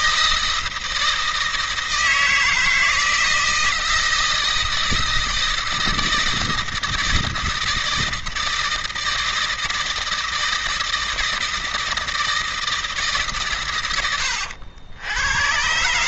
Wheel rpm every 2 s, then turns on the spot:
160, 160, 160, 160, 160, 160, 160, 100.
none